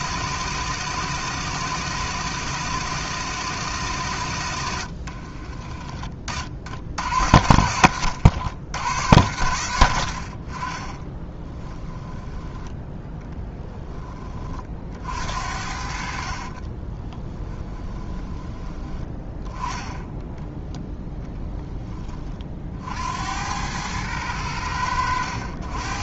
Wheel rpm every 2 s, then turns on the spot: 130, 120, 80, 60, 90, 30, 10, 40, 30, 20, 0, 50, 90.
16-18